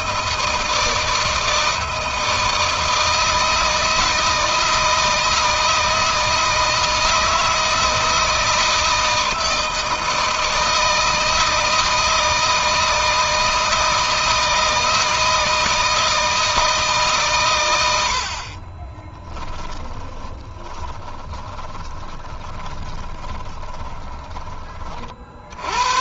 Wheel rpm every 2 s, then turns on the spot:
160, 160, 160, 160, 160, 160, 160, 160, 150, 30, 20, 30, 40.
18-24